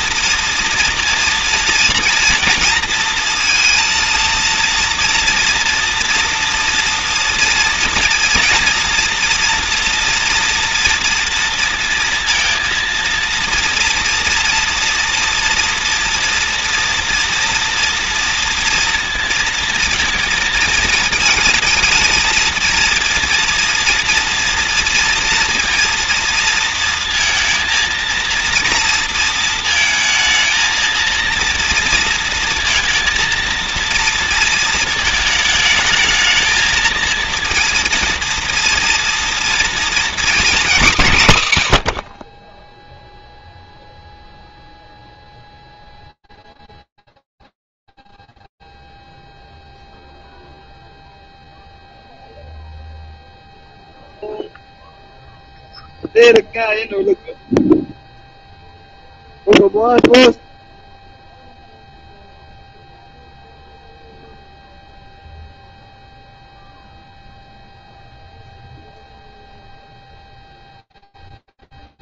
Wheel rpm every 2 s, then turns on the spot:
230, 230, 230, 230, 240, 230, 230, 230, 230, 230, 230, 230, 230, 230, 230, 230, 220, 230, 220, 230, 230, 10, 0, 0, 0, 0, 0, 0, 0, 0, 0, 0, 0, 0, 0, 0.
none